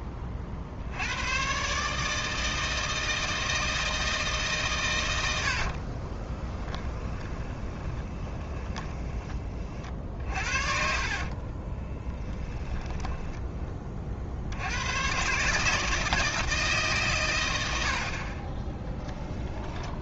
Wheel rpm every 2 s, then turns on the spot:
80, 160, 110, 10, 20, 50, 10, 100, 140, 10.
6-14 18-20